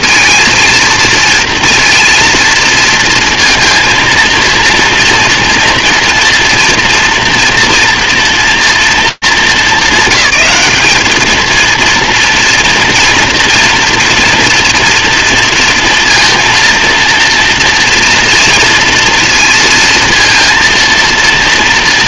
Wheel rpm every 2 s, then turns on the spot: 230, 230, 230, 230, 230, 200, 230, 240, 230, 230, 230.
none